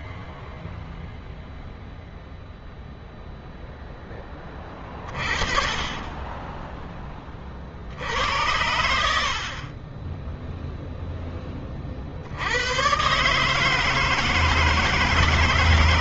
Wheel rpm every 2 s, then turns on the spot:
0, 0, 20, 10, 70, 20, 50, 160.
none